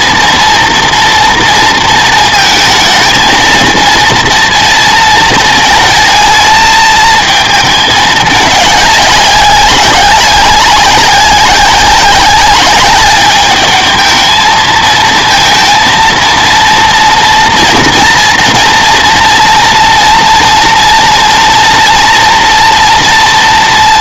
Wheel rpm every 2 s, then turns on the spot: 230, 220, 230, 220, 200, 190, 200, 220, 230, 240, 230, 240.
none